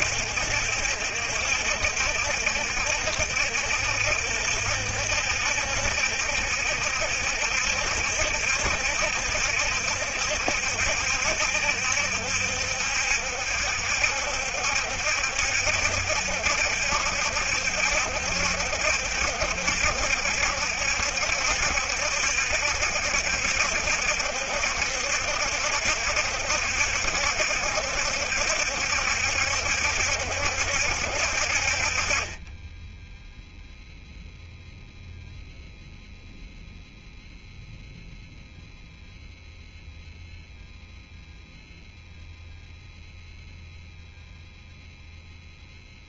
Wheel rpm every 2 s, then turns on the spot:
70, 70, 70, 70, 70, 70, 70, 70, 70, 70, 70, 70, 70, 70, 70, 70, 10, 0, 0, 0, 0, 0, 0.
none